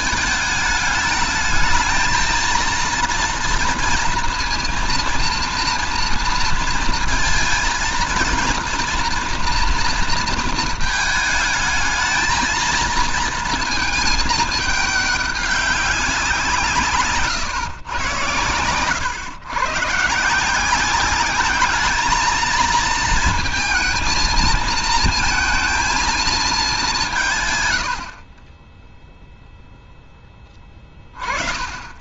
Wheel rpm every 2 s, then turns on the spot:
220, 230, 230, 230, 230, 220, 230, 220, 160, 110, 170, 220, 230, 210, 40, 10.
none